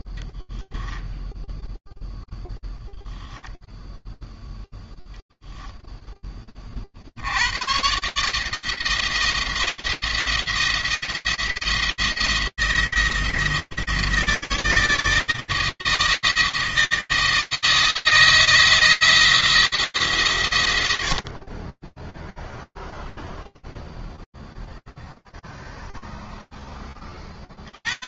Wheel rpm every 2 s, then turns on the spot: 0, 0, 0, 120, 170, 170, 170, 160, 160, 160, 50, 0, 0, 30.
none